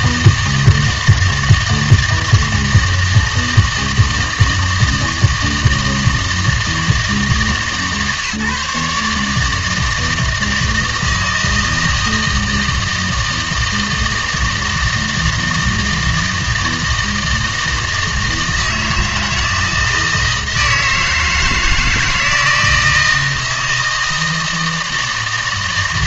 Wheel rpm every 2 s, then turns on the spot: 160, 160, 160, 160, 150, 160, 160, 160, 160, 160, 160, 160, 160.
none